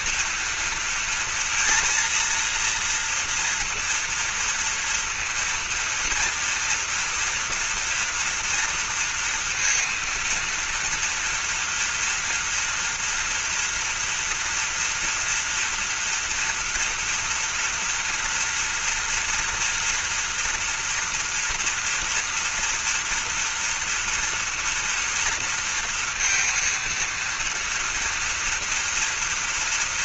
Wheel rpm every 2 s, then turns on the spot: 230, 230, 230, 230, 230, 230, 240, 230, 230, 240, 230, 230, 230, 230, 230.
none